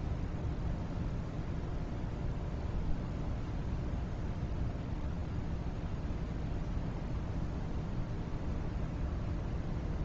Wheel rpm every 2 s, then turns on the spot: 0, 0, 0, 0, 0.
none